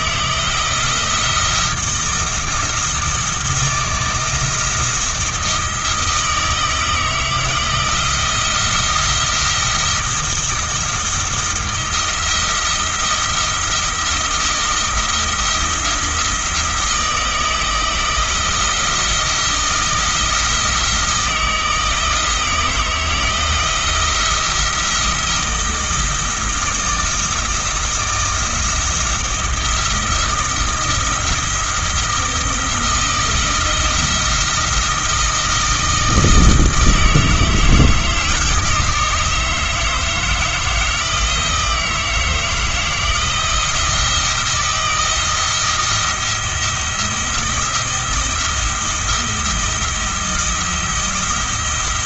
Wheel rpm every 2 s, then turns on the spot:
170, 170, 160, 160, 170, 170, 170, 160, 160, 170, 160, 170, 170, 170, 170, 170, 160, 160, 160, 160, 160, 160, 170, 170, 170, 170.
none